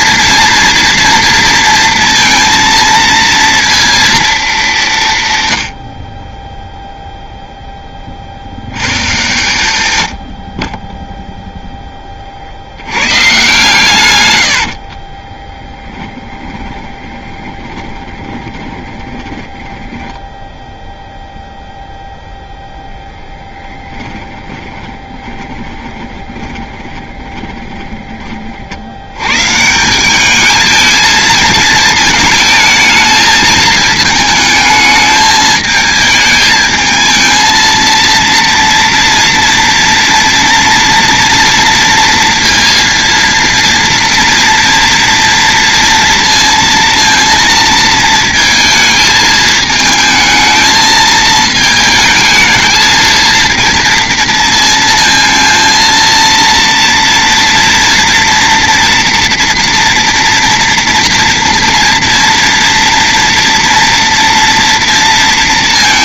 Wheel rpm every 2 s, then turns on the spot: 230, 230, 180, 0, 100, 20, 100, 50, 30, 20, 0, 0, 20, 20, 50, 220, 220, 220, 220, 230, 240, 230, 230, 230, 220, 220, 220, 220, 230, 240, 230, 230, 230.
14-20 24-28